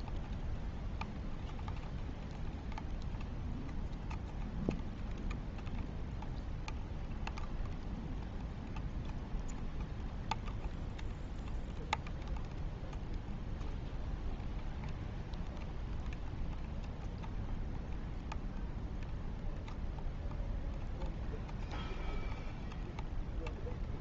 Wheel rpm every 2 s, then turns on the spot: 0, 0, 0, 0, 0, 0, 0, 0, 0, 0, 0, 0.
none